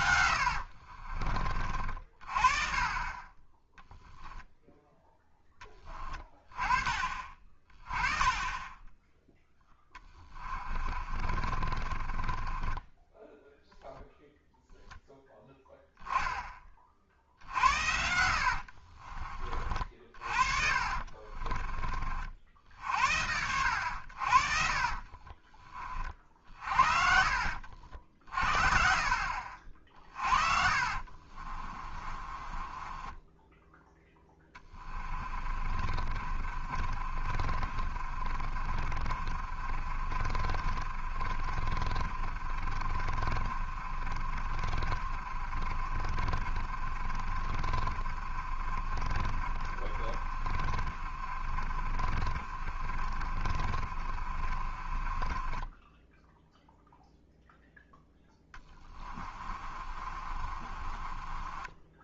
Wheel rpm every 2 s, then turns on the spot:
60, 30, 0, 30, 10, 30, 20, 0, 30, 50, 50, 60, 40, 40, 50, 50, 20, 20, 40, 40, 40, 30, 40, 40, 40, 40, 40, 30, 0, 20, 40.
0-2 10-14 18-22 24-26 30-56 58-62